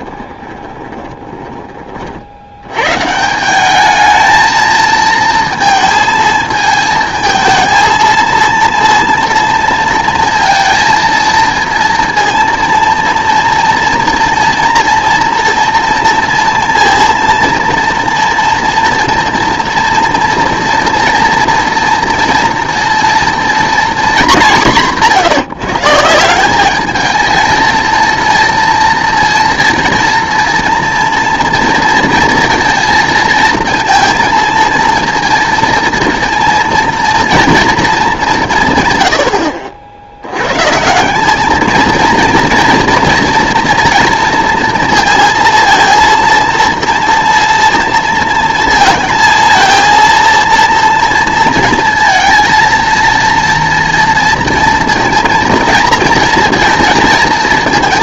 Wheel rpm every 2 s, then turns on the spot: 20, 110, 220, 220, 230, 230, 230, 230, 230, 230, 240, 230, 170, 210, 230, 230, 220, 230, 230, 140, 150, 230, 230, 230, 230, 230, 230, 230, 230.
0-2